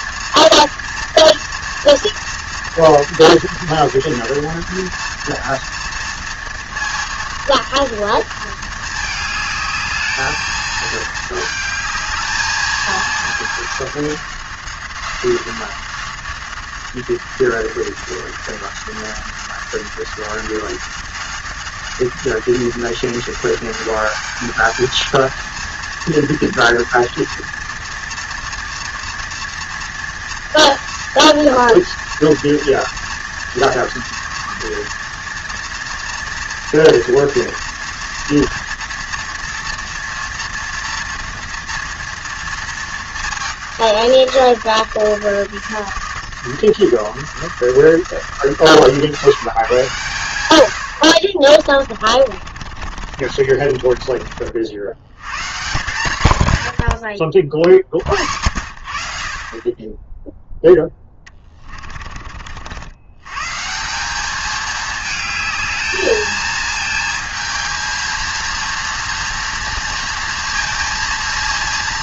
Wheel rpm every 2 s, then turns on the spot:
230, 230, 230, 230, 220, 220, 220, 190, 190, 180, 190, 190, 210, 230, 230, 230, 230, 230, 230, 230, 230, 230, 170, 160, 140, 90, 40, 60, 130, 70, 0, 70, 210, 220, 230, 230.
52-54